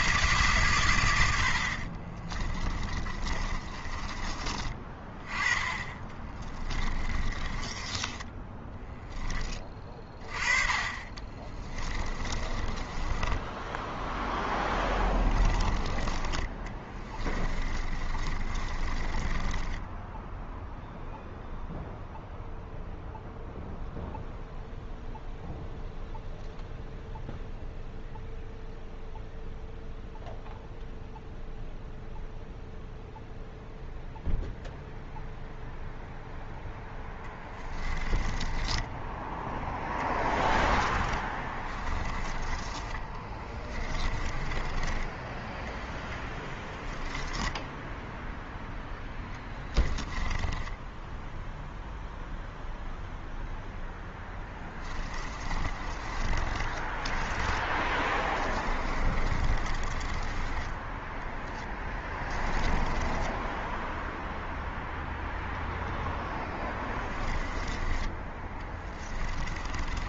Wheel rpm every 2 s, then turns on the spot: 150, 30, 30, 30, 10, 30, 20, 10, 20, 40, 0, 0, 0, 0, 0, 0, 0, 0, 0, 20, 20, 20, 20, 10, 0, 10, 0, 10, 30, 20, 20, 10, 0, 10, 20.
2-4 6-10 12-20 38-42 44-48 50-52 54-64 66-70